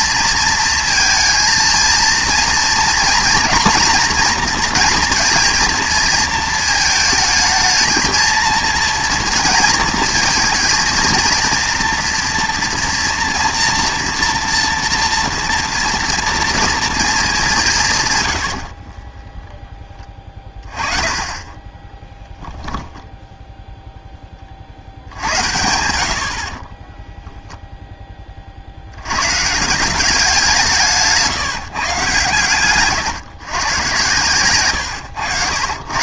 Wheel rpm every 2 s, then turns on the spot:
230, 230, 230, 220, 230, 230, 240, 230, 230, 60, 20, 0, 50, 20, 70, 170, 120, 120.
18-20 26-28